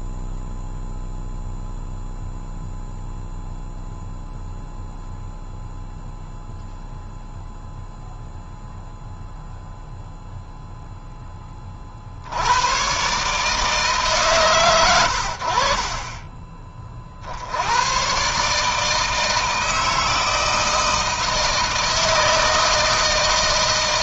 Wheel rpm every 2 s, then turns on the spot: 0, 0, 0, 0, 0, 10, 120, 80, 30, 160, 160, 160.
none